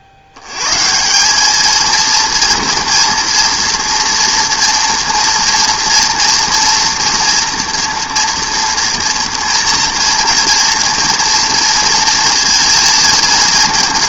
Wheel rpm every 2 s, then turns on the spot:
90, 230, 230, 230, 230, 230, 230.
none